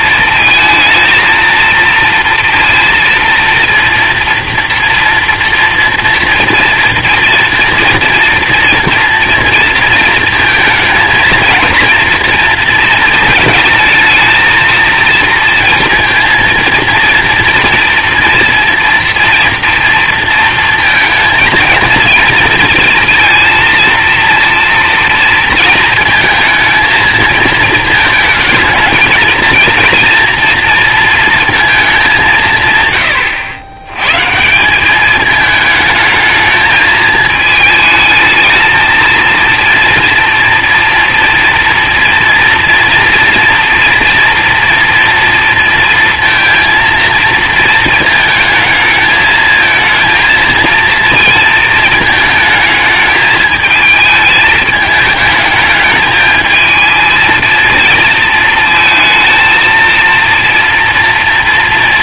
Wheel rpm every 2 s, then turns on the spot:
230, 230, 230, 240, 230, 220, 230, 230, 230, 240, 230, 230, 230, 230, 220, 240, 150, 160, 220, 220, 240, 230, 230, 230, 220, 230, 220, 220, 220, 220, 230.
none